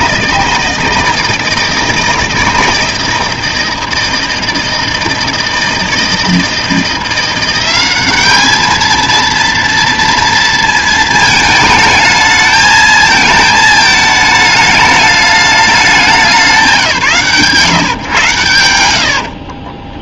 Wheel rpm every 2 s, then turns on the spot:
160, 160, 160, 160, 220, 230, 220, 210, 170, 90.
none